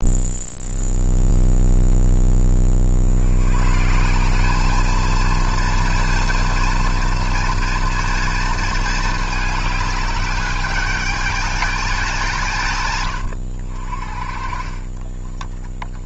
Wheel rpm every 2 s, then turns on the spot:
0, 60, 220, 230, 220, 210, 130, 30.
14-16